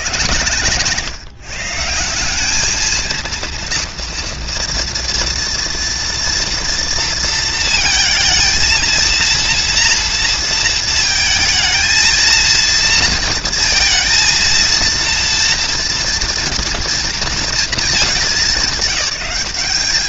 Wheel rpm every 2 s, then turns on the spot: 150, 230, 230, 230, 230, 230, 230, 230, 230, 190.
none